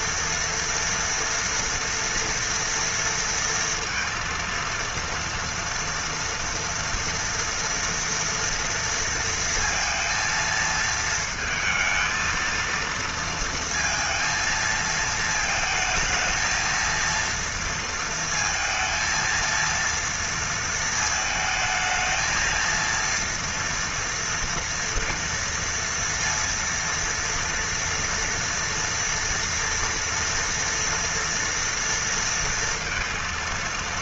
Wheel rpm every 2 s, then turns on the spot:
230, 230, 230, 230, 230, 220, 230, 220, 230, 230, 230, 230, 240, 230, 230, 230, 230.
none